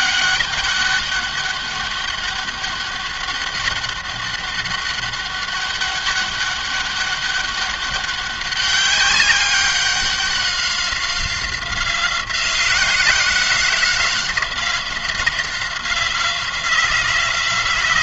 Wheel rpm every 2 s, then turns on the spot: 200, 200, 200, 200, 200, 190, 180, 180, 180.
none